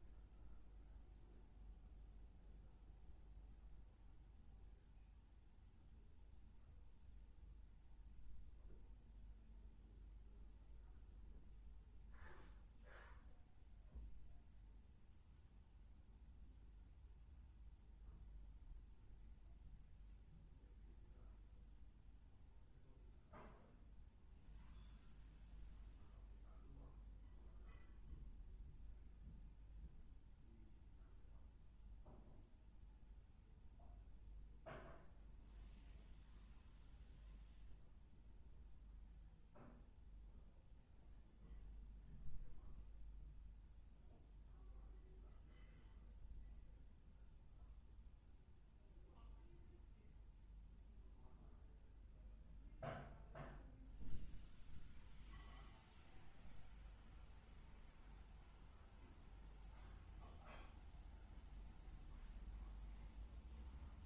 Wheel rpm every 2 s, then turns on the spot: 0, 0, 0, 0, 0, 0, 0, 0, 0, 0, 0, 0, 0, 0, 0, 0, 0, 0, 0, 0, 0, 0, 0, 0, 0, 0, 0, 0, 0, 0, 0, 0.
none